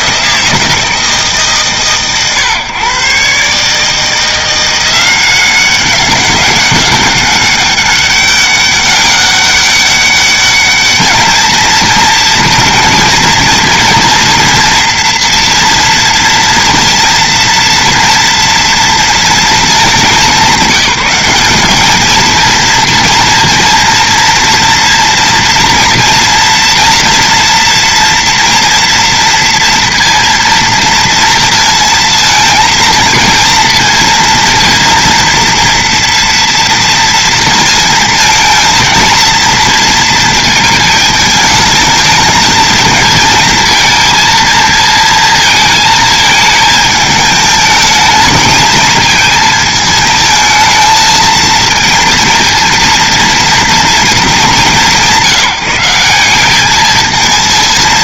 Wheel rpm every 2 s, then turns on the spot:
160, 120, 180, 200, 200, 210, 230, 230, 230, 230, 200, 230, 240, 230, 230, 230, 220, 230, 230, 220, 220, 220, 230, 220, 230, 220, 230, 200, 210.
none